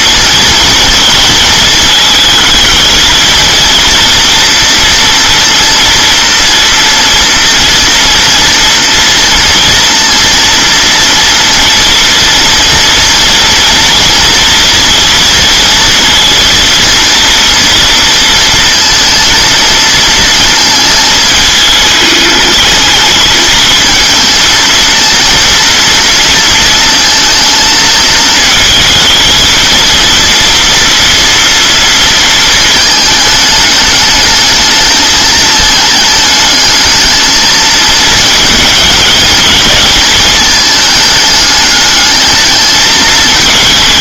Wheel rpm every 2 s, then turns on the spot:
230, 220, 230, 230, 230, 230, 230, 230, 230, 230, 220, 220, 230, 230, 220, 240, 220, 220, 220, 220, 210, 220.
none